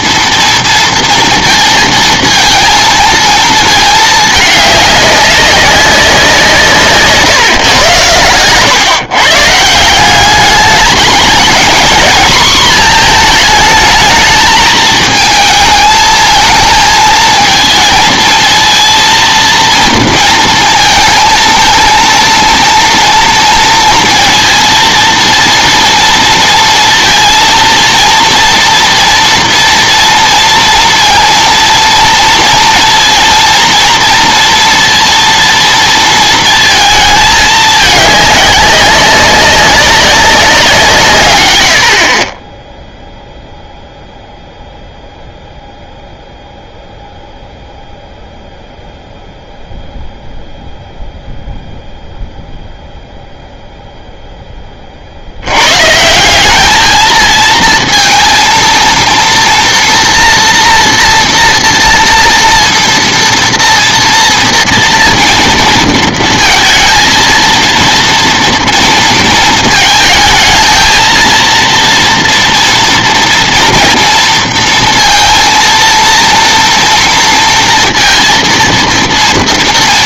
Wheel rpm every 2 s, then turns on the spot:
230, 230, 210, 160, 110, 210, 230, 220, 230, 230, 230, 230, 230, 230, 230, 230, 230, 230, 230, 200, 180, 20, 0, 0, 0, 0, 0, 10, 200, 230, 230, 230, 230, 230, 230, 220, 230, 230, 230, 230.
none